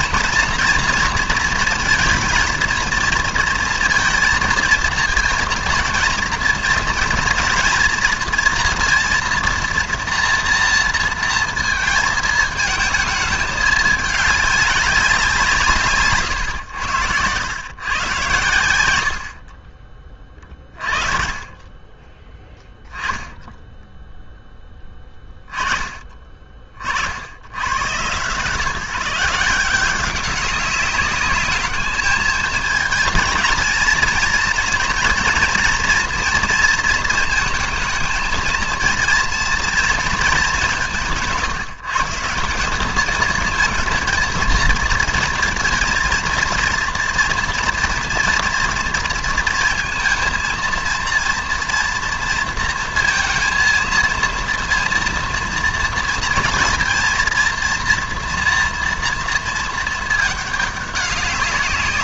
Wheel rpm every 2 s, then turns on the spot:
230, 230, 220, 230, 230, 230, 220, 200, 110, 100, 40, 10, 10, 40, 150, 200, 220, 230, 230, 230, 200, 180, 230, 230, 240, 230, 230, 230, 230, 230, 210.
none